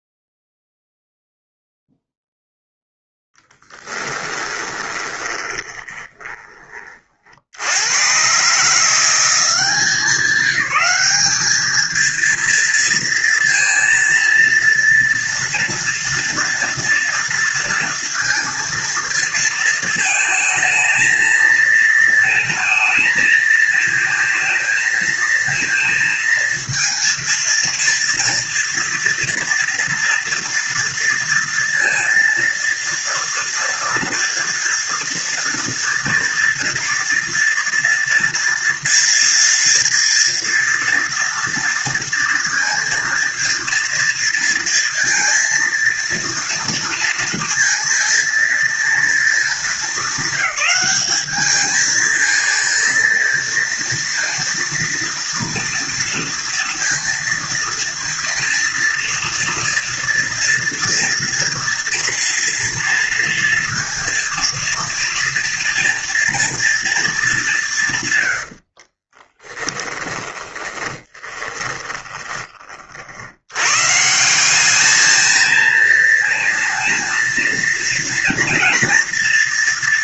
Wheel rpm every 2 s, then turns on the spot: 0, 0, 20, 40, 170, 200, 230, 230, 230, 230, 220, 230, 230, 230, 230, 230, 230, 230, 240, 240, 230, 230, 230, 230, 230, 210, 230, 230, 230, 230, 230, 230, 230, 220, 30, 30, 60, 210, 230, 230.
4-6 68-72